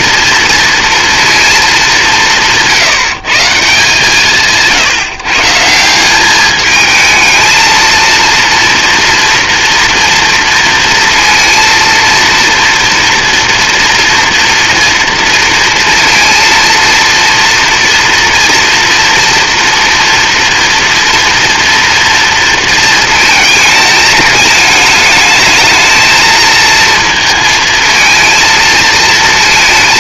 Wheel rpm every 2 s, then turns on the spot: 230, 160, 160, 220, 230, 230, 230, 230, 230, 230, 240, 230, 220, 230, 220.
none